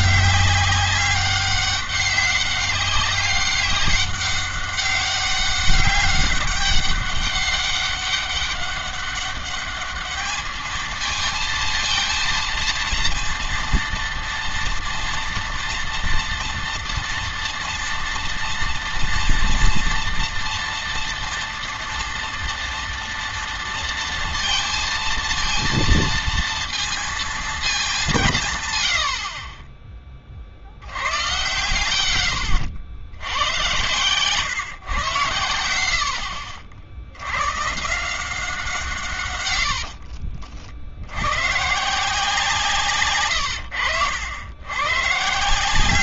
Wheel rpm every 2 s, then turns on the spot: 200, 200, 190, 190, 200, 220, 230, 230, 230, 230, 230, 230, 230, 230, 100, 80, 70, 130, 70, 150, 70, 140, 120.
none